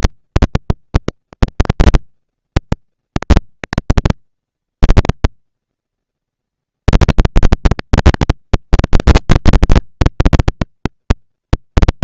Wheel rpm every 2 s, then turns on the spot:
240, 230, 240, 230, 230, 230.
none